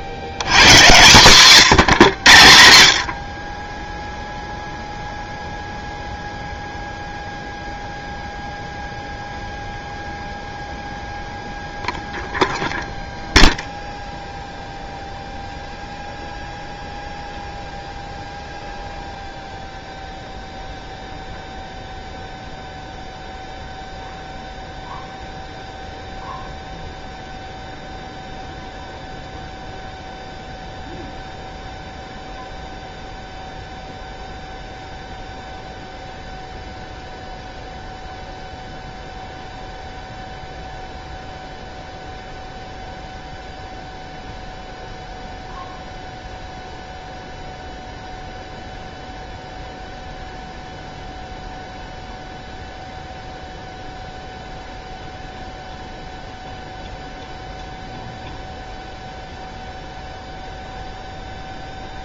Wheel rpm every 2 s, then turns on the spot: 110, 100, 0, 0, 0, 0, 0, 0, 0, 0, 0, 0, 0, 0, 0, 0, 0, 0, 0, 0, 0, 0, 0, 0, 0, 0, 0, 0, 0, 0, 0.
none